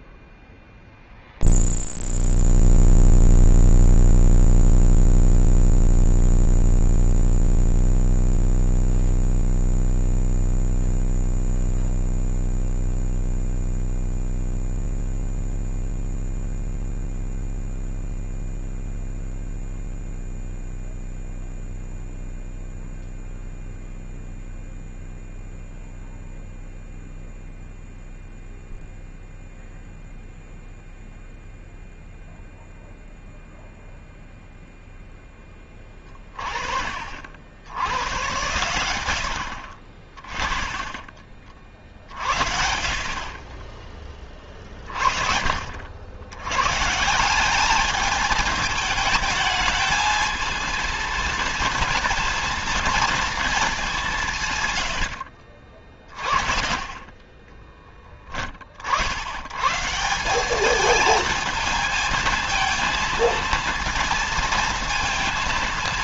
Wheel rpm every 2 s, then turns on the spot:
0, 0, 0, 0, 0, 0, 0, 0, 0, 0, 0, 0, 0, 0, 0, 0, 0, 20, 80, 60, 40, 20, 50, 180, 220, 230, 230, 60, 20, 60, 220, 230, 230.
none